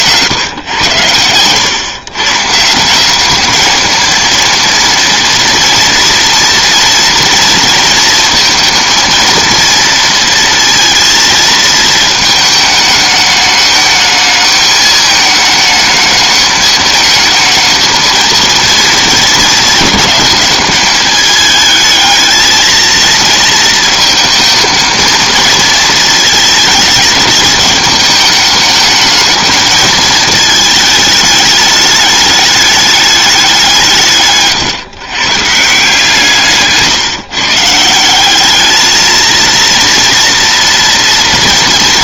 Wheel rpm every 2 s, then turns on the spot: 120, 170, 230, 230, 230, 230, 220, 210, 210, 220, 210, 230, 230, 220, 210, 210, 210, 130, 150, 210, 230.
36-38